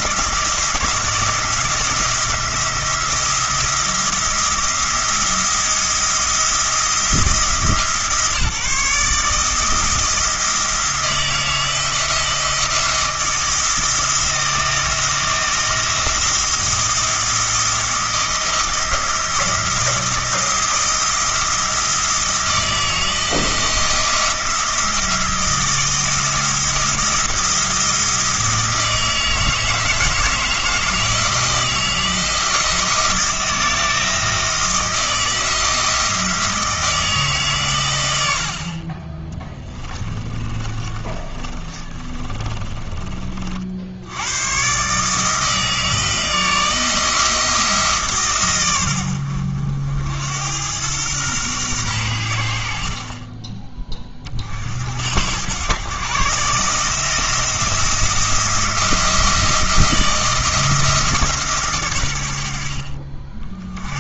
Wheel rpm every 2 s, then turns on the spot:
170, 170, 170, 170, 160, 170, 170, 170, 170, 160, 170, 160, 170, 170, 160, 160, 170, 160, 160, 40, 30, 20, 140, 160, 100, 110, 50, 60, 150, 170, 160, 60.
40-44